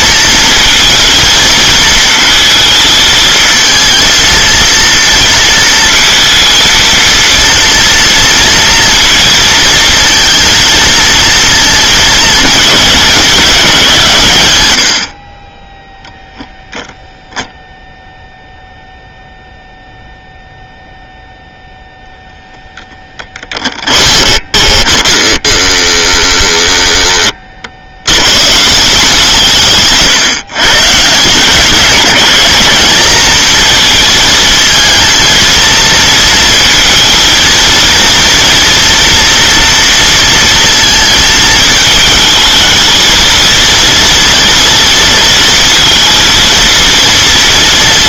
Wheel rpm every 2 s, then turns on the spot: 230, 230, 230, 230, 230, 230, 210, 110, 0, 0, 0, 10, 30, 10, 160, 130, 190, 220, 230, 230, 230, 220, 230, 230.
22-26